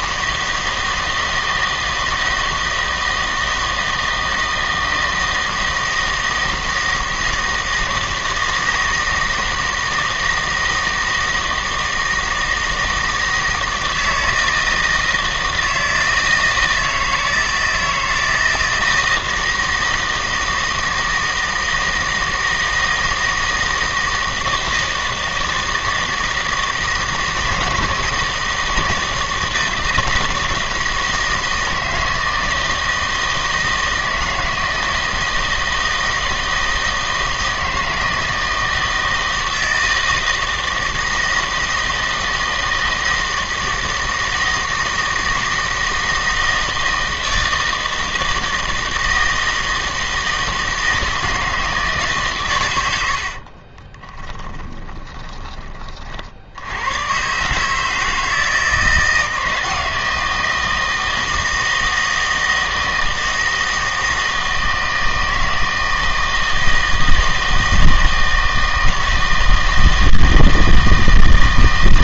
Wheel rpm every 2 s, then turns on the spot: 160, 160, 160, 160, 160, 160, 160, 160, 160, 160, 160, 160, 160, 160, 160, 160, 160, 160, 160, 160, 160, 160, 160, 160, 160, 160, 110, 20, 90, 160, 160, 160, 160, 160, 160, 160.
54-56